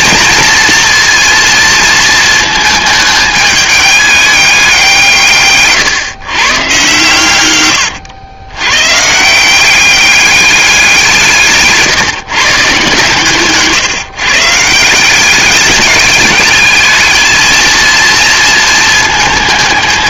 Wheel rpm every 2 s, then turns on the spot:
230, 220, 180, 130, 120, 190, 140, 150, 210, 220.
none